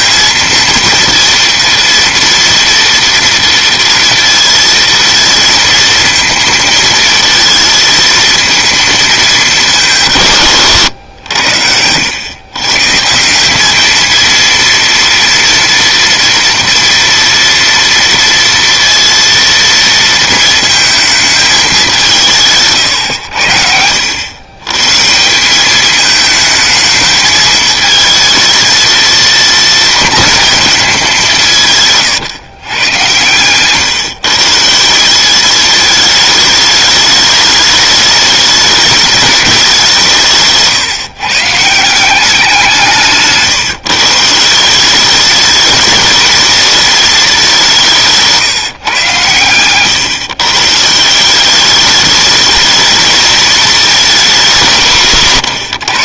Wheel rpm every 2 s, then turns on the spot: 230, 230, 230, 220, 230, 120, 130, 230, 240, 230, 220, 130, 120, 220, 230, 220, 110, 170, 210, 210, 150, 180, 180, 210, 150, 150, 220, 140.
none